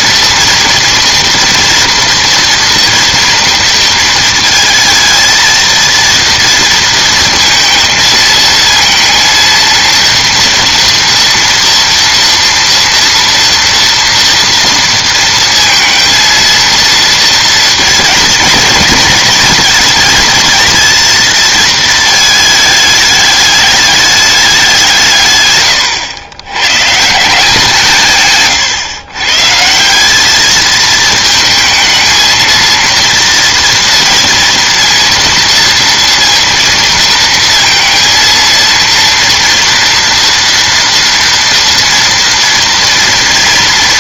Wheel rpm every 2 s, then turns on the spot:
230, 230, 230, 230, 230, 230, 240, 230, 230, 230, 220, 210, 170, 120, 140, 220, 230, 230, 230, 230, 230, 230.
none